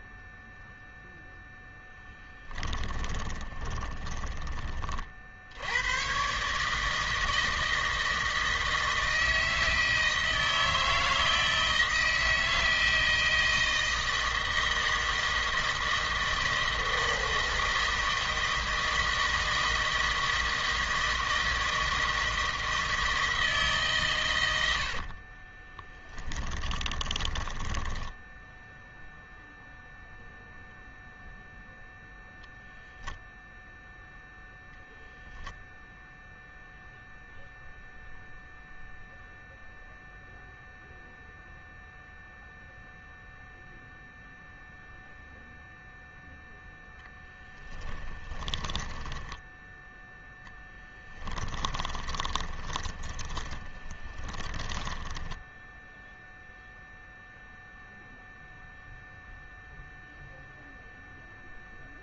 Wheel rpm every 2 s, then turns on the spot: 0, 20, 30, 160, 160, 160, 160, 160, 160, 160, 160, 160, 70, 20, 0, 0, 0, 0, 0, 0, 0, 0, 0, 0, 10, 10, 30, 20, 0, 0, 0.
2-4 26-28 48-56